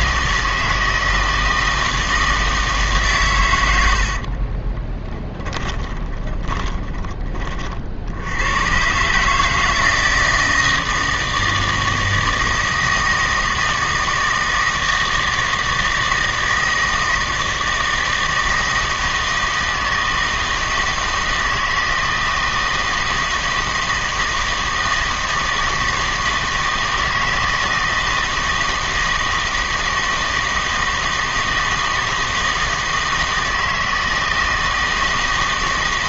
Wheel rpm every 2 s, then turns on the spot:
160, 140, 20, 20, 130, 160, 160, 160, 160, 160, 160, 160, 160, 160, 160, 160, 160, 160.
4-6